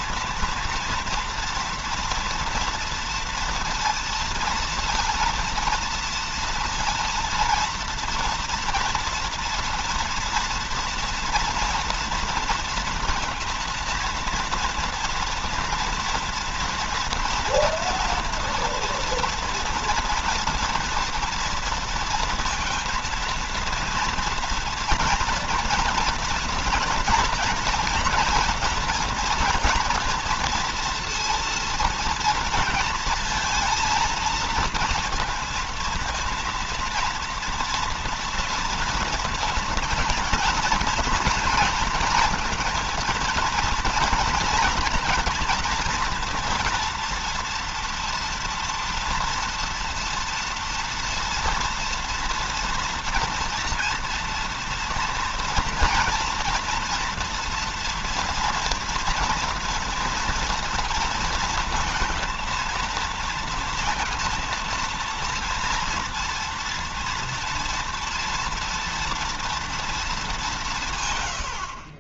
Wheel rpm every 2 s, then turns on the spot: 230, 230, 230, 230, 230, 230, 230, 230, 240, 230, 230, 230, 230, 240, 230, 230, 230, 230, 230, 240, 230, 230, 230, 230, 230, 230, 230, 230, 240, 230, 230, 230, 230, 240, 230, 180.
none